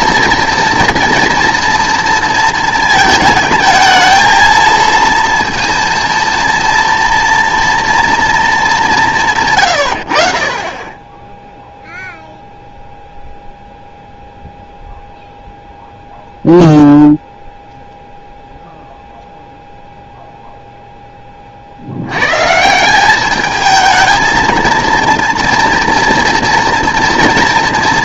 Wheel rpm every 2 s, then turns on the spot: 230, 230, 230, 230, 200, 30, 0, 0, 0, 0, 0, 160, 230, 230.
none